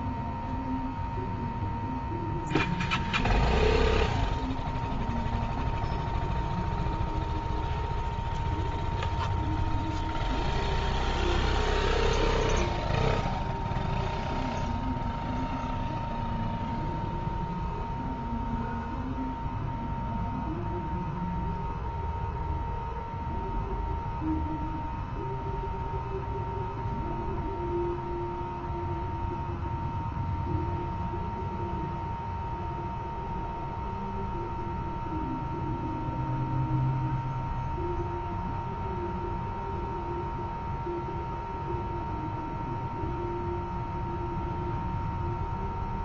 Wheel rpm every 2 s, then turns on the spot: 0, 0, 0, 0, 0, 0, 0, 0, 0, 0, 0, 0, 0, 0, 0, 0, 0, 0, 0, 0, 0, 0, 0.
none